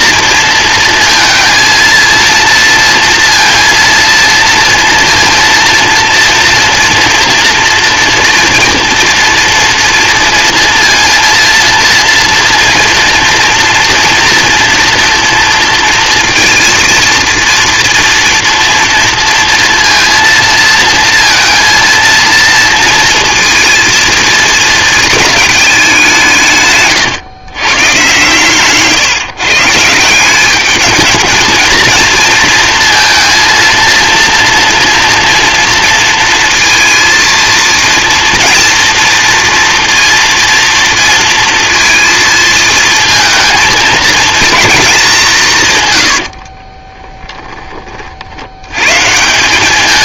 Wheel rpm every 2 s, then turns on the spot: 230, 230, 230, 230, 230, 230, 230, 230, 230, 240, 230, 230, 220, 140, 140, 210, 230, 230, 230, 230, 230, 230, 220, 50, 100.
46-48